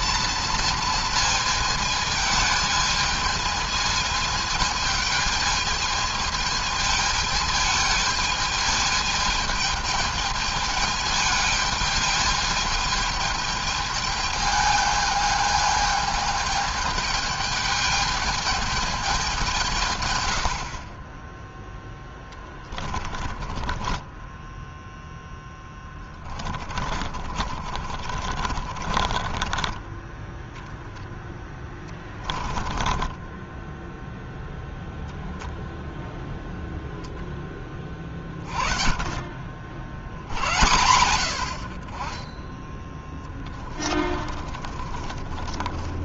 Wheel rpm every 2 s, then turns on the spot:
230, 220, 220, 220, 220, 220, 220, 220, 210, 210, 90, 30, 10, 20, 40, 10, 20, 0, 0, 30, 80, 20, 30.
22-30 32-34 44-46